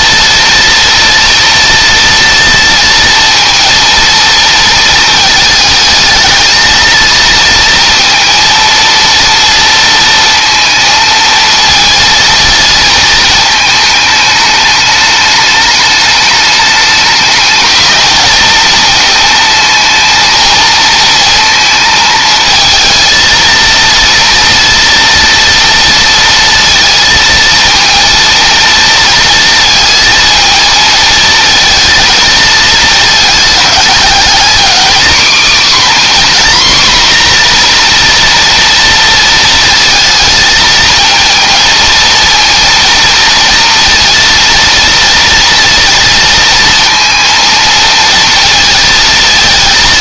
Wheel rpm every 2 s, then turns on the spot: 230, 230, 220, 230, 230, 230, 220, 210, 210, 220, 230, 220, 230, 230, 230, 220, 220, 250, 250, 230, 220, 230, 230, 230, 220.
none